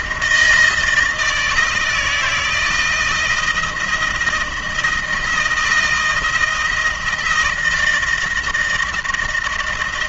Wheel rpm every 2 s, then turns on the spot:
160, 160, 160, 170, 160.
none